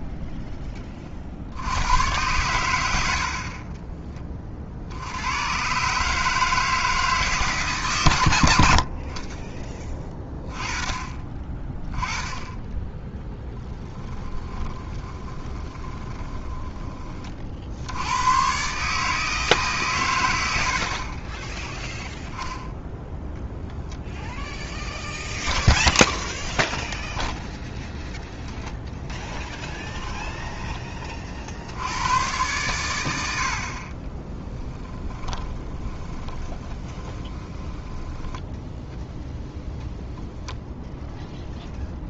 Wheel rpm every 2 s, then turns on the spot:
20, 90, 60, 160, 70, 20, 10, 20, 20, 140, 60, 0, 0, 0, 0, 20, 110, 20, 20, 10, 0.
14-16 34-38